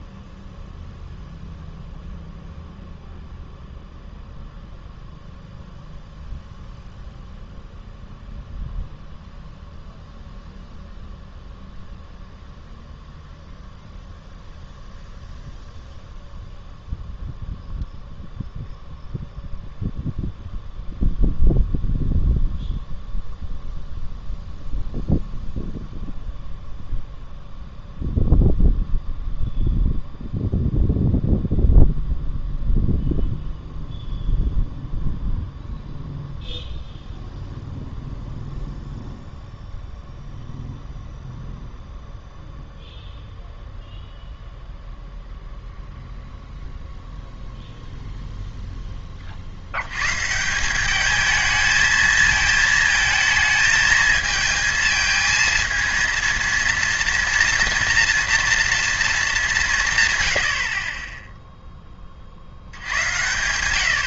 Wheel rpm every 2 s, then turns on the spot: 0, 0, 0, 0, 0, 0, 0, 0, 0, 0, 0, 0, 0, 0, 0, 0, 0, 0, 0, 0, 0, 0, 0, 0, 10, 180, 220, 220, 230, 230, 60, 70.
none